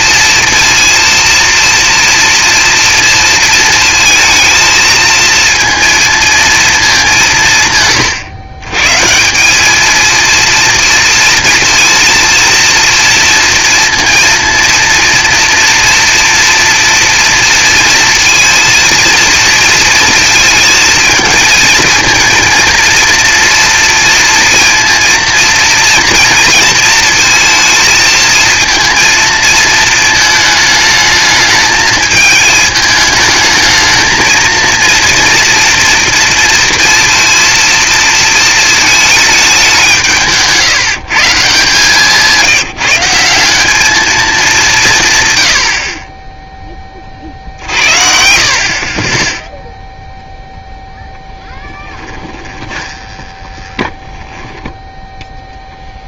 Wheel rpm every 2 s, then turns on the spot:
230, 230, 220, 230, 130, 230, 230, 230, 230, 230, 230, 230, 230, 230, 230, 220, 210, 230, 230, 230, 160, 180, 190, 10, 40, 0, 20, 10.
52-54